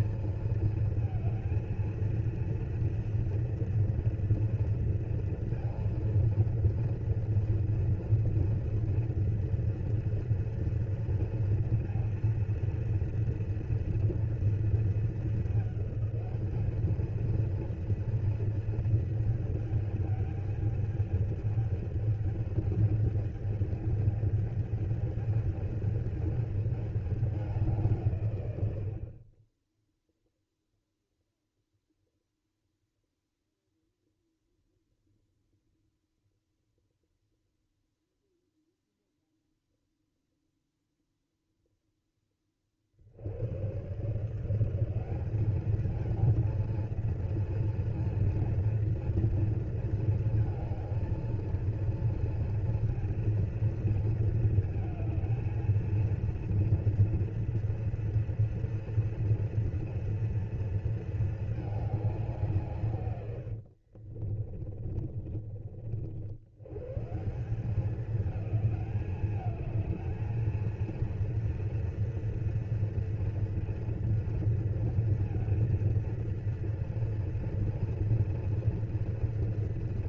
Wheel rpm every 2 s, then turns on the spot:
220, 230, 240, 230, 230, 230, 230, 230, 210, 220, 210, 210, 220, 210, 60, 0, 0, 0, 0, 0, 0, 40, 180, 230, 230, 220, 230, 220, 230, 230, 230, 150, 30, 120, 210, 230, 230, 230, 230, 230.
64-66